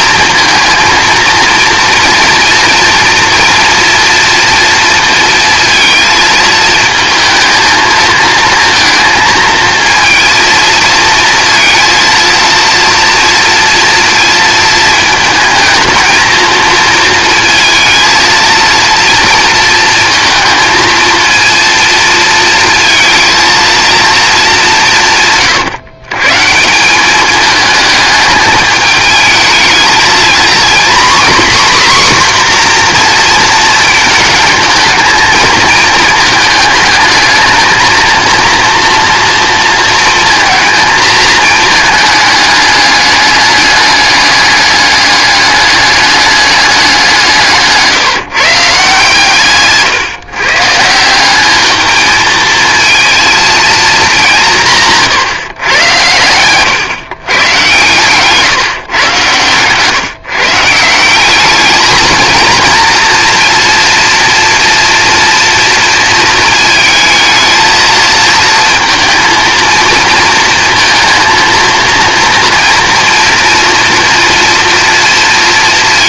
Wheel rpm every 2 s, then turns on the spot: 230, 230, 230, 220, 230, 230, 230, 230, 230, 230, 220, 230, 190, 170, 220, 250, 250, 220, 220, 230, 220, 210, 200, 190, 150, 150, 220, 170, 120, 140, 160, 230, 230, 220, 230, 230, 230, 230.
none